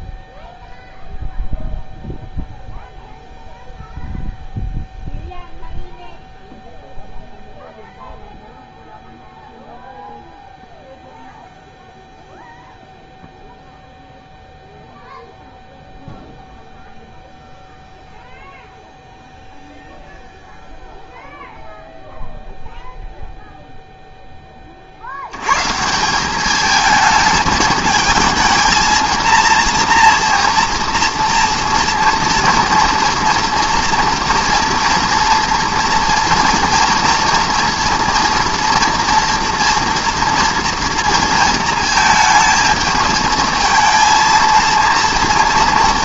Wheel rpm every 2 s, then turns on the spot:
0, 0, 0, 0, 0, 0, 0, 0, 0, 0, 0, 0, 30, 210, 220, 230, 230, 230, 230, 230, 230, 220, 230.
none